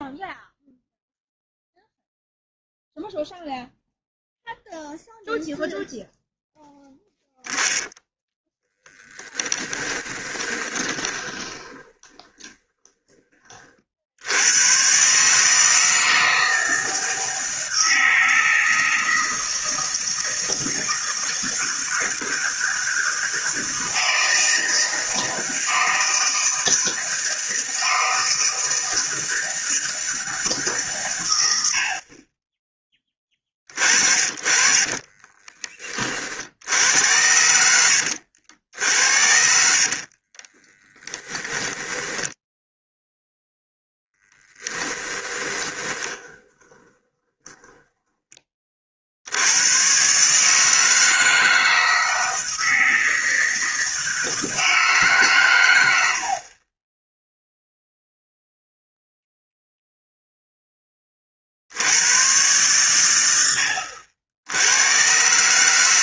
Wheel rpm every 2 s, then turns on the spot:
0, 0, 0, 0, 20, 20, 20, 120, 160, 160, 160, 160, 160, 160, 160, 140, 10, 30, 70, 70, 10, 0, 10, 20, 40, 160, 160, 140, 10, 0, 20, 100, 100.
8-14 34-38 40-42 44-48